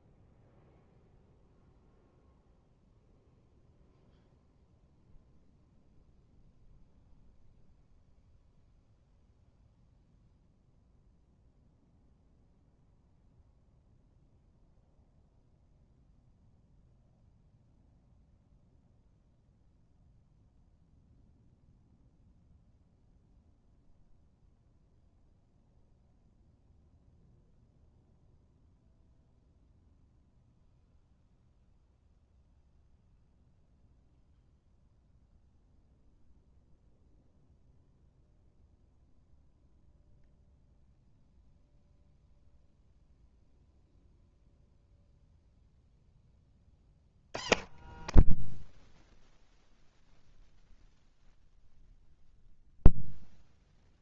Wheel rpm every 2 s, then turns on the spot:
0, 0, 0, 0, 0, 0, 0, 0, 0, 0, 0, 0, 0, 0, 0, 0, 0, 0, 0, 0, 0, 0, 0, 40, 60, 0, 0.
none